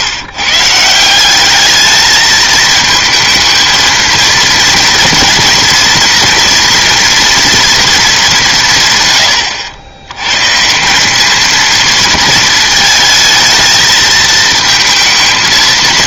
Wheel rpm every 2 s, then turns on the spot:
160, 220, 230, 240, 160, 150, 230, 220.
none